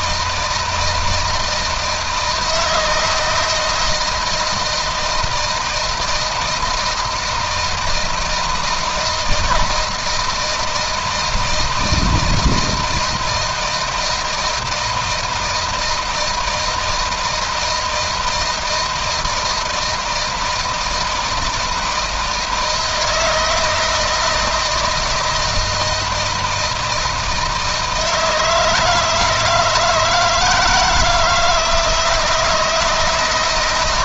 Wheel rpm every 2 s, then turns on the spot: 160, 160, 160, 160, 160, 160, 160, 160, 160, 160, 160, 170, 160, 160, 160, 160, 160.
none